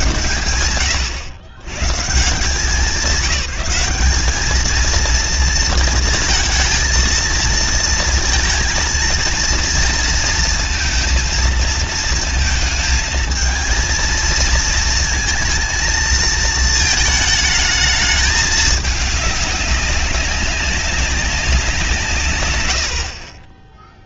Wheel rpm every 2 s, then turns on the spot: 110, 200, 230, 230, 230, 230, 220, 230, 220, 200, 180, 10.
none